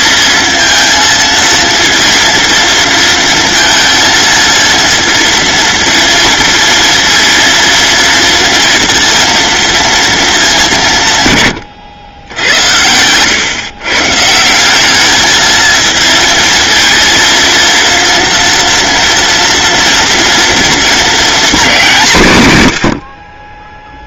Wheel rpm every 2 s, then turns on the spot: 230, 230, 230, 230, 230, 180, 90, 190, 230, 230, 240, 100.
12-14